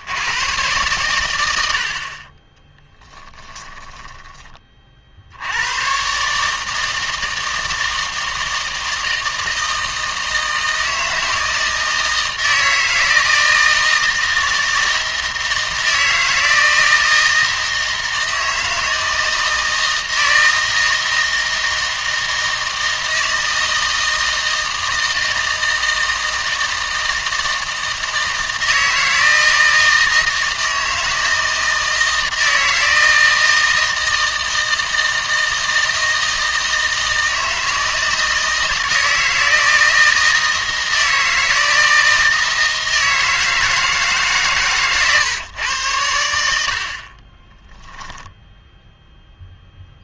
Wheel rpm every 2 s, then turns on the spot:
110, 10, 30, 160, 160, 160, 160, 160, 160, 160, 160, 160, 160, 160, 160, 160, 160, 160, 160, 160, 160, 160, 130, 60, 0.
2-4